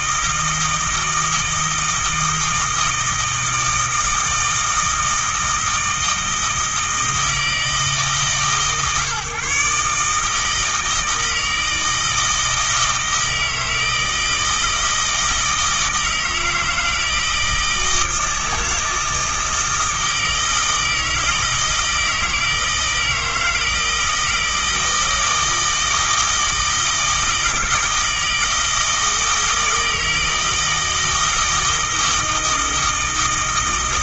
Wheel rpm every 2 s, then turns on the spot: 160, 160, 160, 160, 140, 160, 160, 160, 160, 160, 160, 160, 160, 160, 160, 160, 160.
none